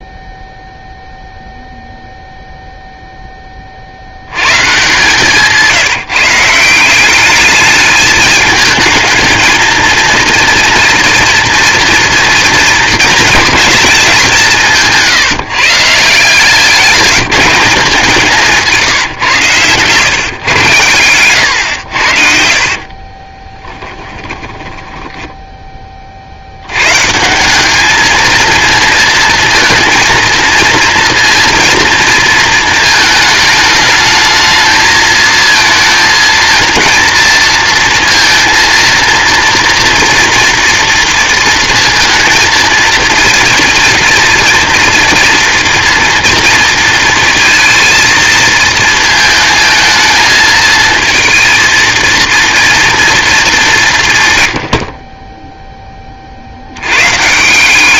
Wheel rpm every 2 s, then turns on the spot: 0, 0, 120, 170, 220, 230, 220, 170, 170, 170, 120, 50, 10, 80, 230, 230, 230, 220, 230, 230, 240, 230, 230, 230, 230, 220, 230, 130, 70.
22-26